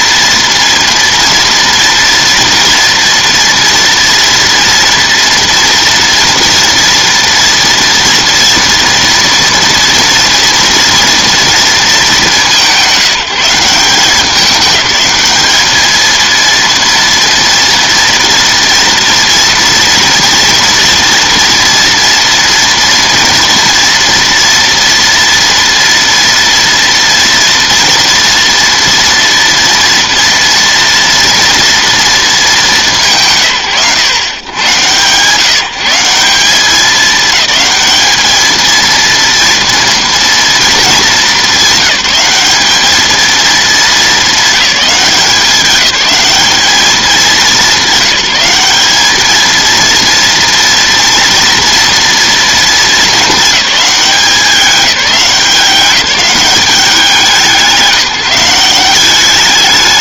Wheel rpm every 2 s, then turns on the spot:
230, 240, 230, 230, 230, 230, 180, 200, 230, 240, 240, 230, 230, 230, 240, 230, 200, 110, 180, 230, 220, 210, 200, 200, 200, 230, 220, 190, 180, 180.
none